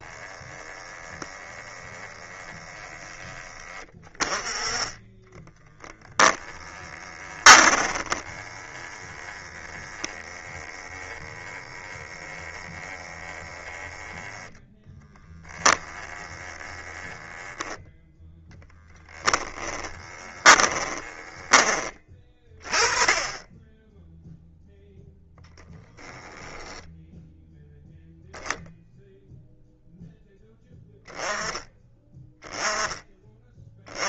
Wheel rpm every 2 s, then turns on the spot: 10, 10, 30, 20, 10, 10, 10, 10, 10, 10, 20, 20, 0, 10, 0, 10, 10.
4-8 18-22